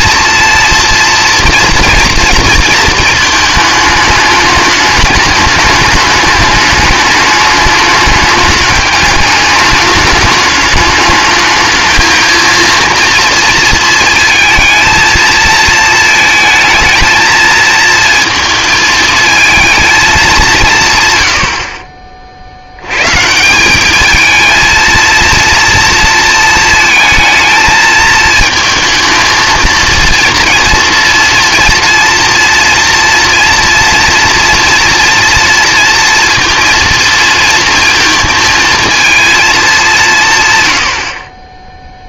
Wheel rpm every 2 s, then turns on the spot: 230, 230, 210, 210, 200, 220, 230, 220, 220, 230, 160, 90, 220, 230, 220, 230, 240, 230, 230, 230, 110.
none